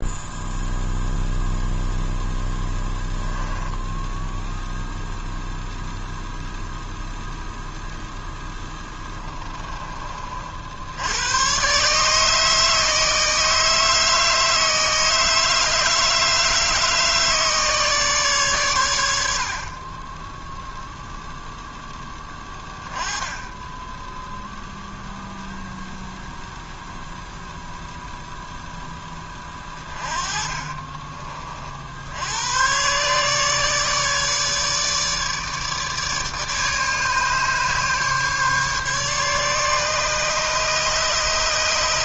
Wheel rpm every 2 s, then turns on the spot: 0, 10, 0, 0, 10, 80, 160, 160, 150, 110, 0, 10, 0, 0, 10, 30, 120, 150, 150, 150, 130.
2-4 8-10